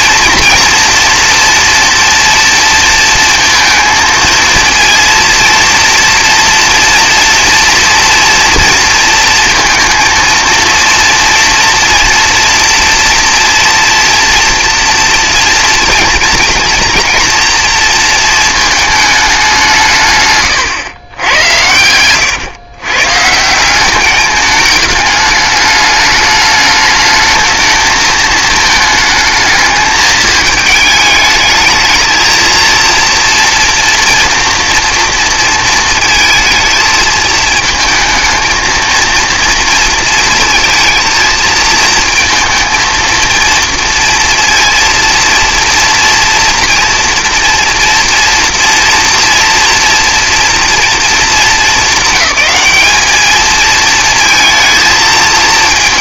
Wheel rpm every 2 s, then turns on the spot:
230, 230, 230, 230, 230, 230, 230, 230, 230, 220, 130, 130, 210, 210, 220, 220, 230, 240, 220, 230, 230, 230, 230, 230, 230, 230, 200, 220.
none